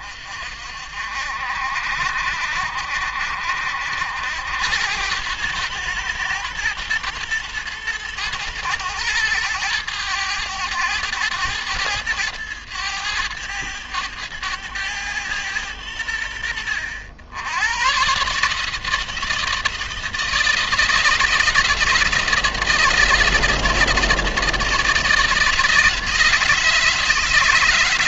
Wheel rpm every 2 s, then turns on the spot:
50, 60, 90, 110, 110, 100, 110, 110, 70, 160, 170, 170, 160, 150.
none